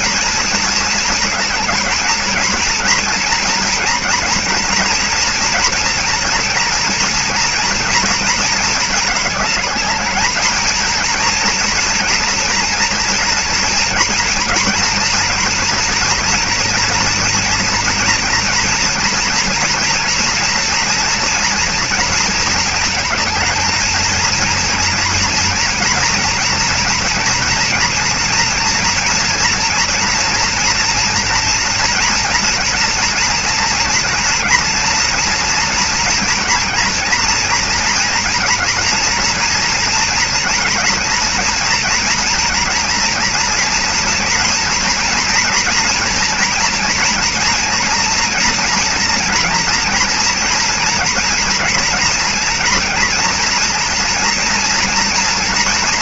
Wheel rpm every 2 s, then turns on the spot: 230, 230, 240, 230, 220, 230, 230, 230, 240, 230, 240, 220, 230, 230, 230, 230, 230, 230, 240, 240, 230, 230, 230, 240, 230, 230, 230, 230.
none